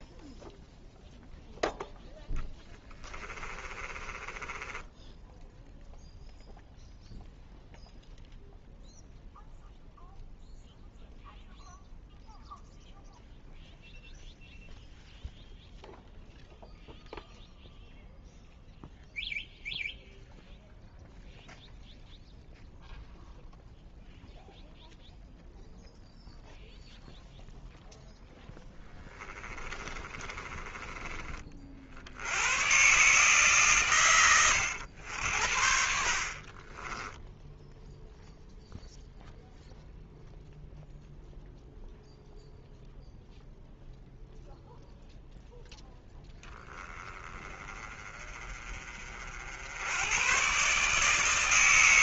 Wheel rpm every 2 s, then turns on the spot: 0, 10, 10, 0, 0, 0, 0, 0, 0, 0, 0, 0, 0, 0, 10, 30, 130, 90, 20, 0, 0, 0, 0, 20, 40, 150.
2-6 28-30 36-38